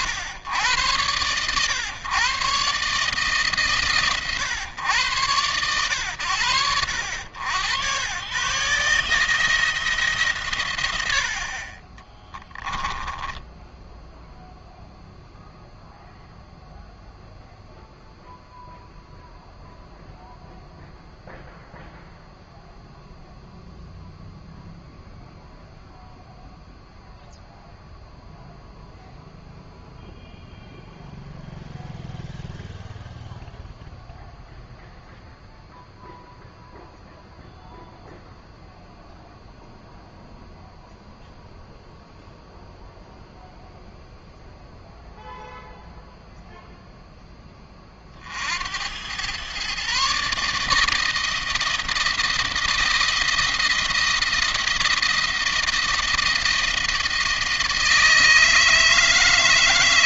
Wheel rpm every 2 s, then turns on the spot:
100, 130, 120, 80, 130, 130, 10, 0, 0, 0, 0, 0, 0, 0, 0, 0, 0, 0, 0, 0, 0, 0, 0, 0, 70, 150, 160, 170, 160, 160.
12-14